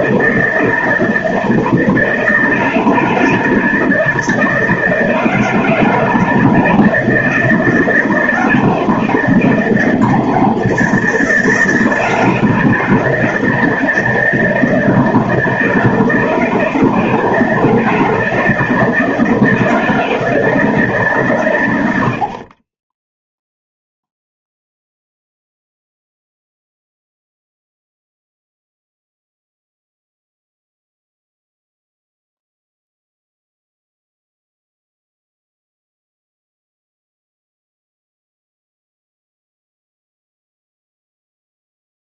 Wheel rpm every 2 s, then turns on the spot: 160, 160, 160, 160, 170, 170, 160, 160, 160, 160, 160, 20, 0, 0, 0, 0, 0, 0, 0, 0, 0.
none